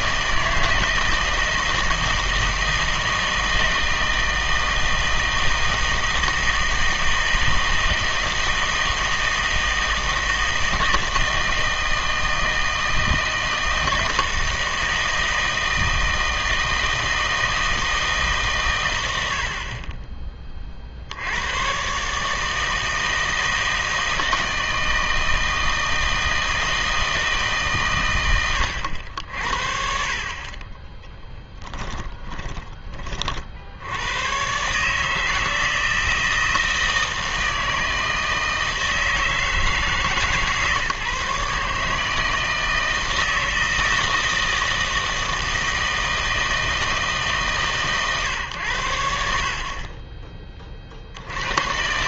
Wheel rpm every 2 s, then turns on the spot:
160, 160, 160, 160, 160, 160, 160, 160, 160, 120, 40, 160, 160, 160, 90, 20, 20, 140, 160, 160, 140, 160, 160, 160, 90, 30.
none